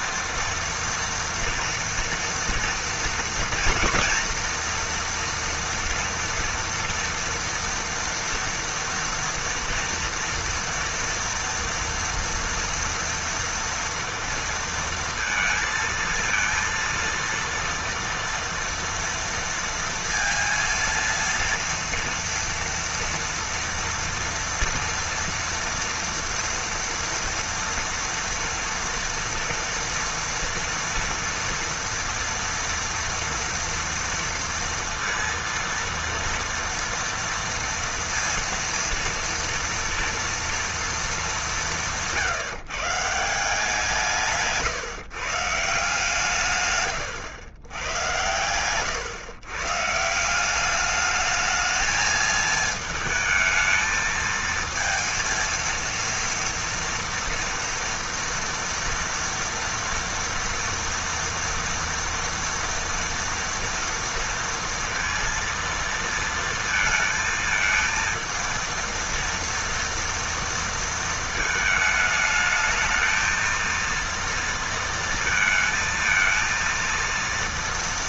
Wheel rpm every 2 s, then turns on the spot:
230, 230, 240, 230, 230, 230, 230, 230, 230, 230, 230, 230, 230, 230, 240, 230, 230, 230, 230, 230, 240, 150, 150, 150, 100, 190, 220, 220, 230, 230, 230, 230, 230, 230, 230, 230, 220, 230, 230.
none